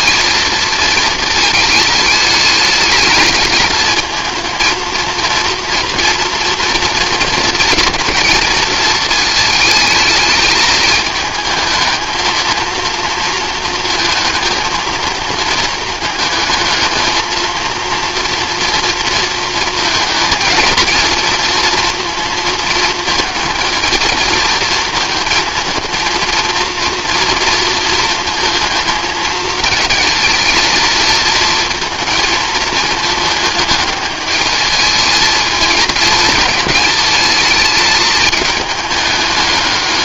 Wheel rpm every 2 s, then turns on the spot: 230, 210, 230, 240, 220, 210, 220, 230, 220, 230, 220, 220, 220, 230, 220, 230, 220, 210, 220, 210.
none